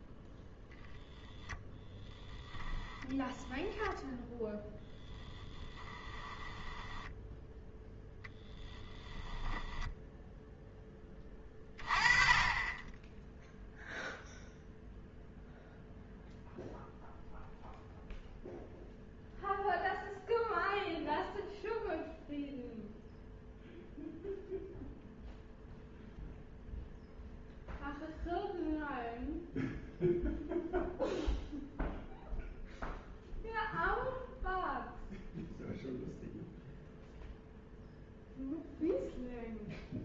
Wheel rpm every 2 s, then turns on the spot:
0, 10, 10, 10, 10, 10, 20, 0, 0, 0, 0, 0, 0, 0, 0, 0, 0, 0, 0, 0.
4-8